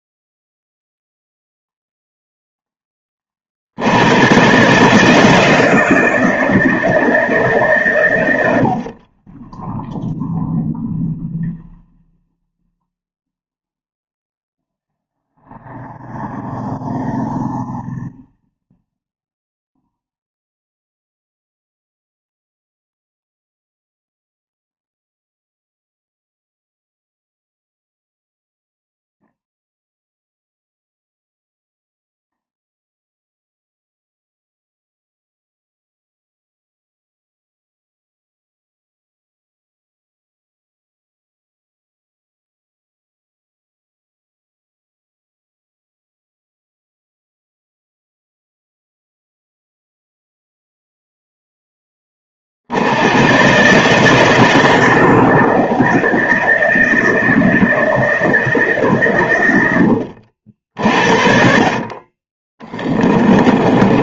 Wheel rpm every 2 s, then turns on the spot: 0, 10, 150, 150, 50, 0, 0, 0, 0, 0, 0, 0, 0, 0, 0, 0, 0, 0, 0, 0, 0, 0, 0, 0, 0, 0, 70, 160, 170, 150, 60, 20.
62-64